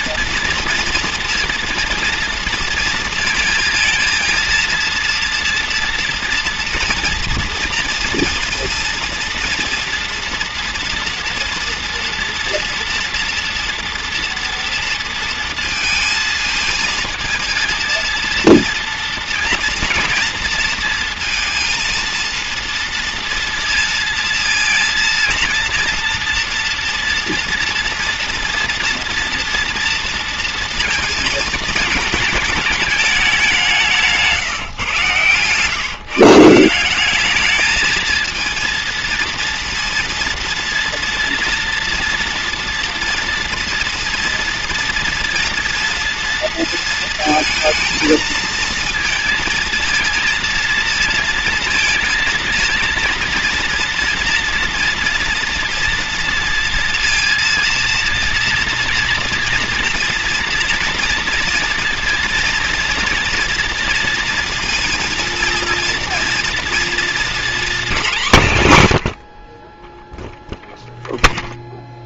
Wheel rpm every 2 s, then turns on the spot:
230, 230, 230, 230, 230, 230, 240, 240, 220, 230, 230, 230, 230, 230, 230, 230, 210, 150, 170, 230, 230, 230, 230, 230, 230, 230, 230, 230, 230, 230, 230, 230, 230, 230, 170, 0.
none